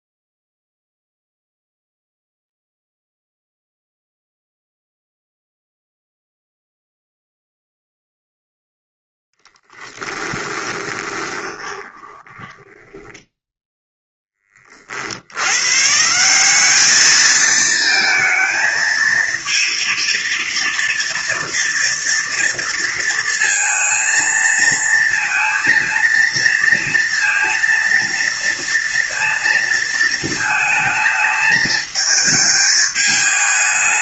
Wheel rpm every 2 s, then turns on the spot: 0, 0, 0, 0, 0, 20, 10, 50, 210, 230, 230, 230, 230, 230, 230, 220, 220.
10-14